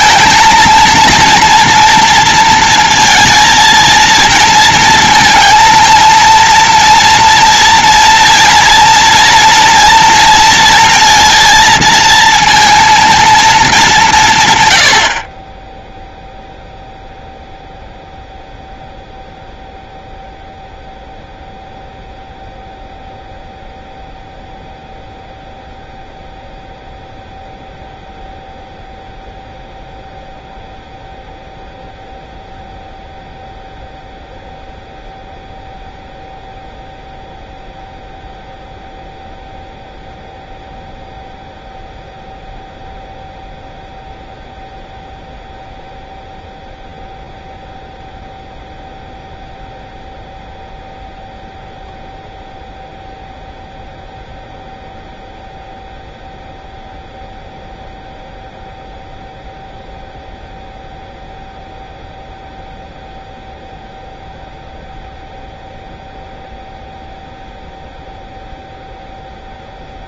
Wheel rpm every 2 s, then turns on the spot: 230, 230, 230, 230, 230, 230, 230, 80, 0, 0, 0, 0, 0, 0, 0, 0, 0, 0, 0, 0, 0, 0, 0, 0, 0, 0, 0, 0, 0, 0, 0, 0, 0, 0, 0.
none